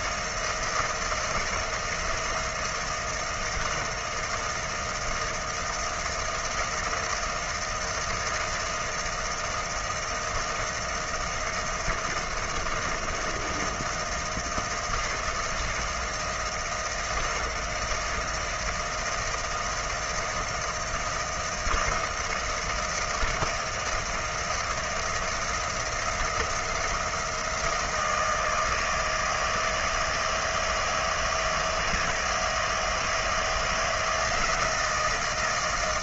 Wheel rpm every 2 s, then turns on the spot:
160, 160, 160, 160, 160, 160, 160, 160, 160, 160, 160, 160, 160, 170, 160, 160, 160, 160.
none